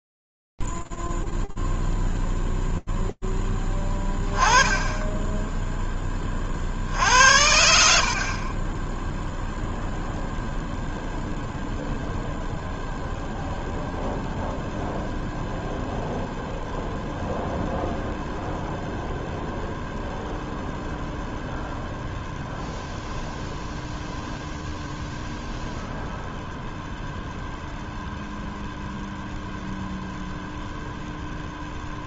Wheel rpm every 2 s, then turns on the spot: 0, 0, 10, 40, 30, 0, 0, 0, 0, 0, 0, 0, 0, 0, 0, 0.
none